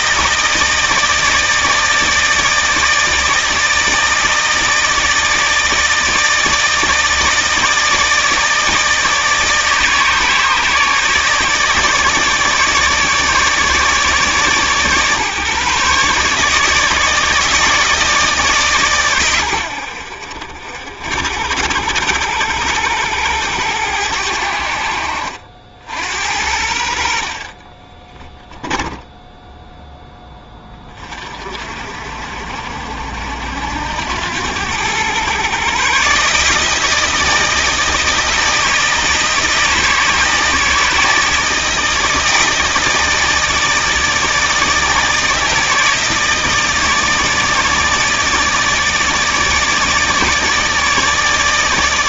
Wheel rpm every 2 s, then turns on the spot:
160, 160, 160, 160, 160, 150, 150, 140, 150, 130, 60, 100, 70, 60, 10, 30, 70, 100, 160, 160, 160, 160, 160, 160, 150, 150.
28-30